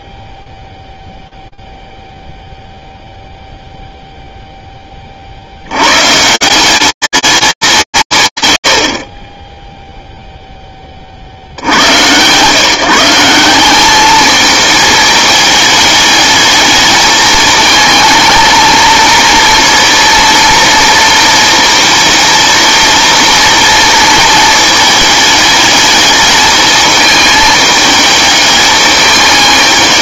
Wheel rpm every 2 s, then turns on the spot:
10, 0, 10, 190, 100, 10, 150, 220, 220, 220, 230, 230, 220, 220, 200.
none